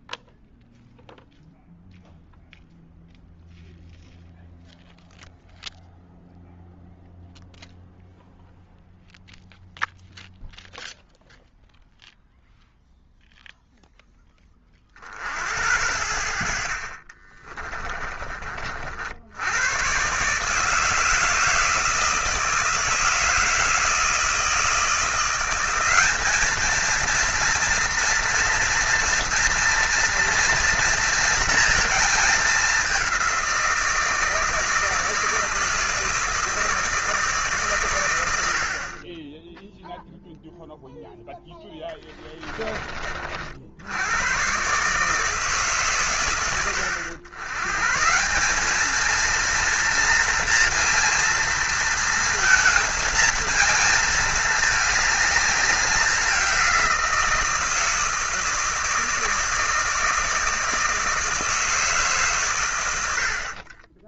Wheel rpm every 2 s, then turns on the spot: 0, 0, 0, 0, 0, 0, 0, 30, 50, 40, 150, 160, 160, 220, 230, 230, 210, 160, 160, 60, 0, 40, 130, 90, 200, 230, 230, 220, 180, 160, 160, 80.
42-44